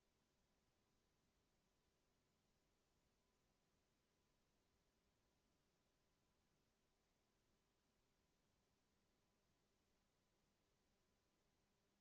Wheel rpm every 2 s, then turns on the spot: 0, 0, 0, 0, 0, 0.
none